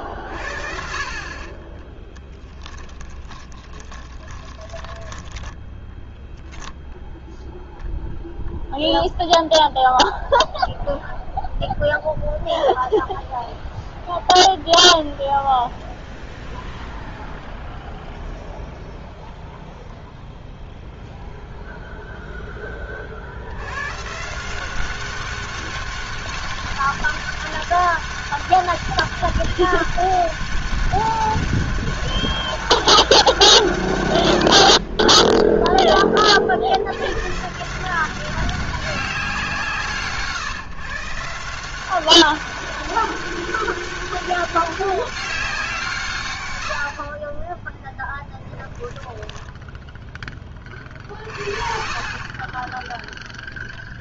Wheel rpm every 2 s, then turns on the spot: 50, 10, 10, 0, 0, 0, 0, 0, 0, 0, 0, 30, 190, 200, 200, 200, 200, 50, 80, 190, 140, 200, 190, 80, 10, 40, 10.
2-6 48-50